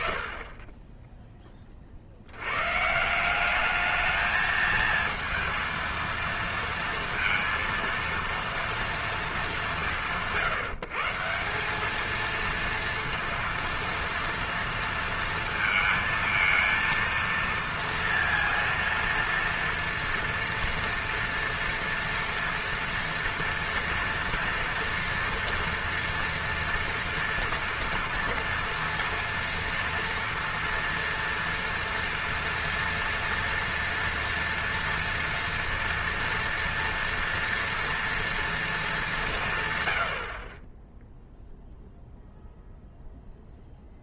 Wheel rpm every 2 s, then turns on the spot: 10, 190, 230, 230, 180, 170, 230, 230, 230, 230, 230, 230, 230, 230, 230, 240, 240, 230, 230, 200, 0, 0.
none